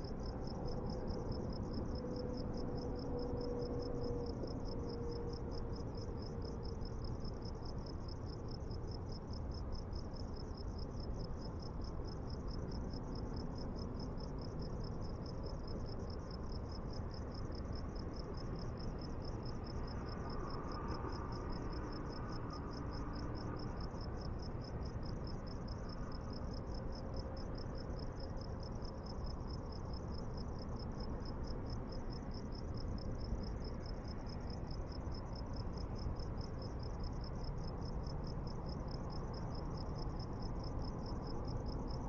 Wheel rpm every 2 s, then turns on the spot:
0, 0, 0, 0, 0, 0, 0, 0, 0, 0, 0, 0, 0, 0, 0, 0, 0, 0, 0, 0, 0.
none